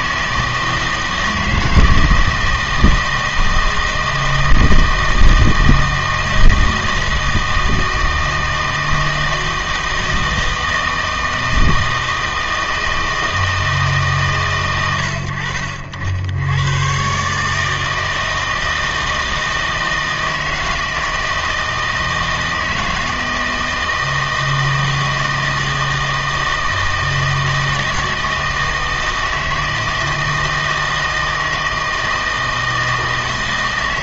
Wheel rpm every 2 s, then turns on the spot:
160, 160, 160, 160, 160, 160, 160, 120, 110, 160, 160, 160, 160, 160, 160, 160, 160.
none